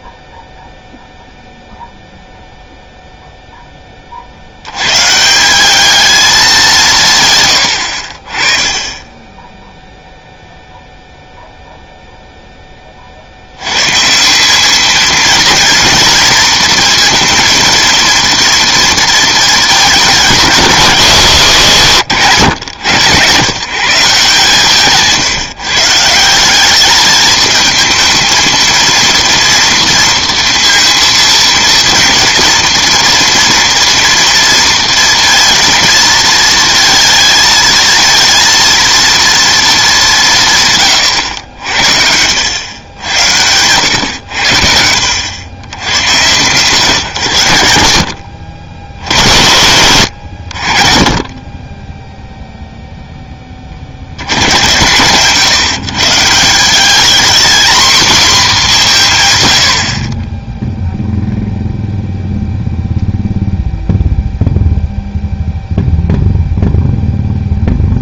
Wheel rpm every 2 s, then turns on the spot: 0, 0, 110, 190, 20, 0, 20, 220, 230, 230, 150, 110, 150, 200, 230, 230, 230, 230, 230, 230, 140, 90, 70, 130, 70, 50, 0, 110, 190, 200, 0, 0, 0, 0.
none